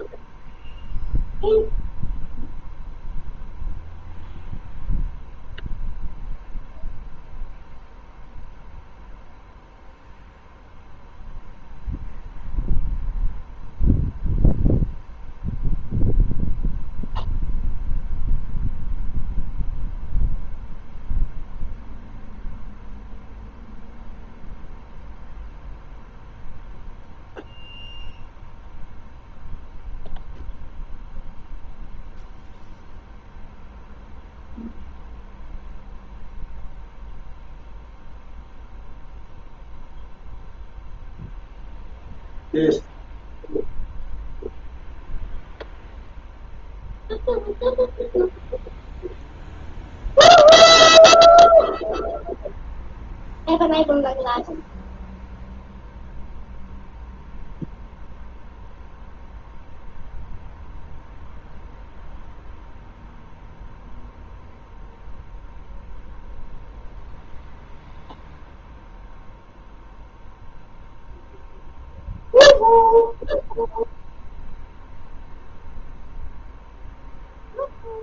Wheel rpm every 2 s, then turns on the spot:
0, 0, 0, 0, 0, 0, 0, 0, 0, 0, 0, 0, 0, 0, 0, 0, 0, 0, 0, 0, 0, 0, 0, 0, 0, 0, 0, 0, 0, 0, 0, 0, 0, 0, 0, 0, 0, 0, 0.
none